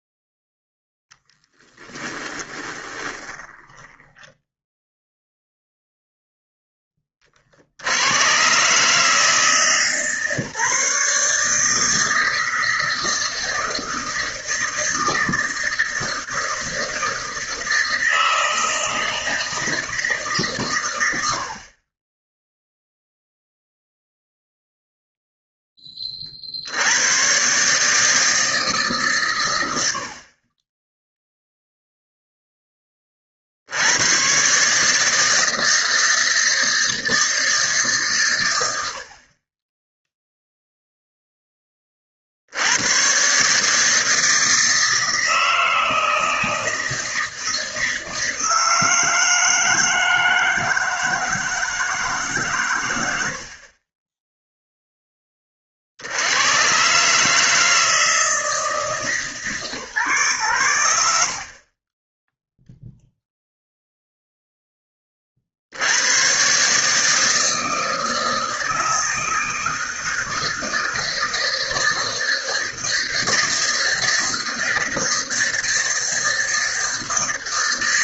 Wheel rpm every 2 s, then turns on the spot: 0, 20, 0, 10, 140, 150, 160, 160, 160, 160, 100, 0, 0, 70, 150, 20, 10, 150, 160, 90, 0, 90, 160, 160, 160, 160, 120, 0, 120, 160, 100, 0, 10, 140, 160, 160, 160, 160, 160.
2-4